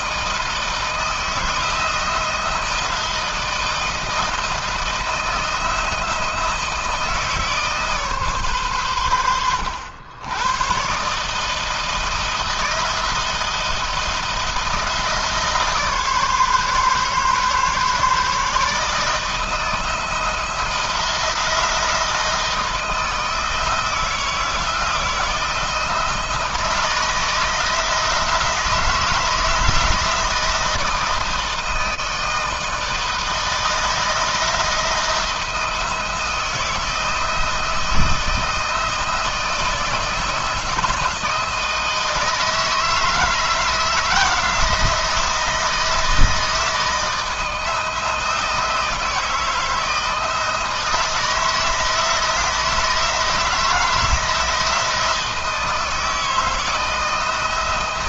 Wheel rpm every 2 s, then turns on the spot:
160, 170, 170, 160, 120, 130, 160, 160, 140, 150, 170, 160, 160, 160, 170, 160, 160, 160, 160, 160, 160, 160, 170, 160, 160, 160, 160, 160, 160.
none